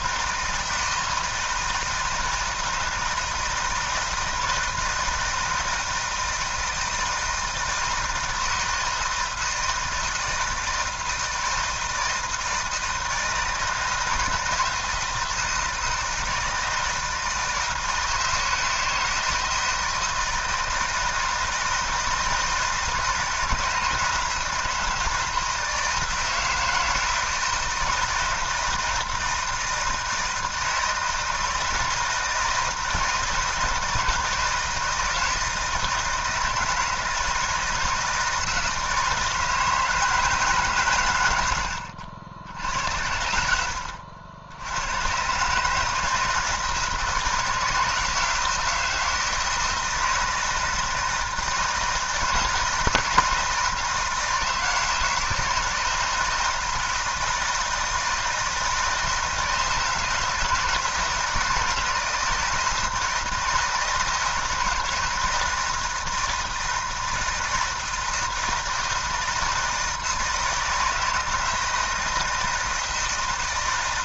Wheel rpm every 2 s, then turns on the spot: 160, 160, 160, 160, 160, 160, 160, 160, 160, 160, 160, 160, 160, 170, 160, 160, 160, 160, 160, 160, 150, 80, 90, 160, 160, 160, 160, 160, 160, 160, 160, 160, 160, 160, 160, 160, 160.
none